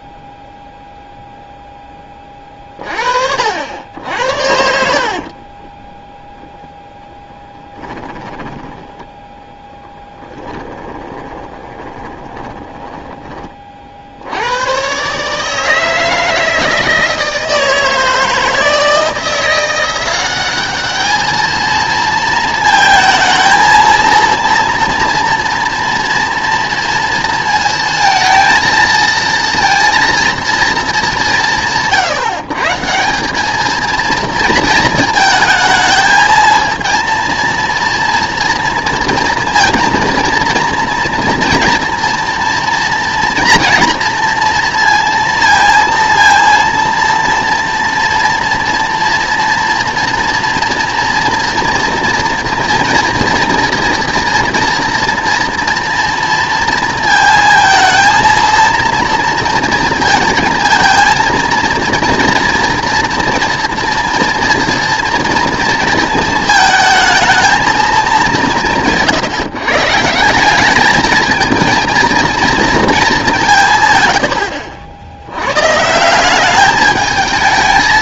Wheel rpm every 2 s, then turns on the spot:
0, 30, 60, 0, 10, 20, 10, 110, 160, 160, 200, 220, 240, 230, 230, 220, 160, 220, 230, 230, 230, 230, 230, 230, 230, 230, 230, 230, 230, 230, 230, 230, 240, 220, 160, 210, 220, 70, 210.
4-6 10-14